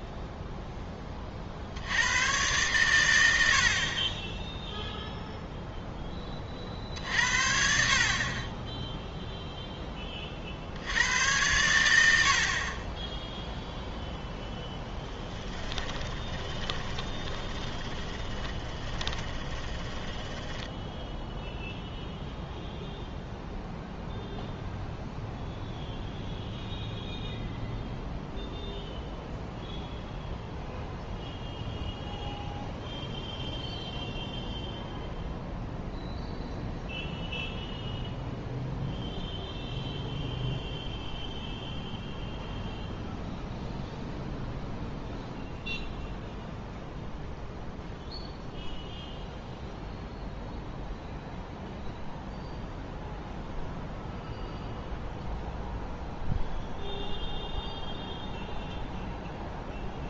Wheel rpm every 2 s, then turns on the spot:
10, 110, 0, 40, 20, 70, 40, 0, 20, 20, 10, 0, 0, 0, 0, 0, 0, 0, 0, 0, 0, 0, 0, 0, 0, 0, 0, 0, 0, 0.
16-22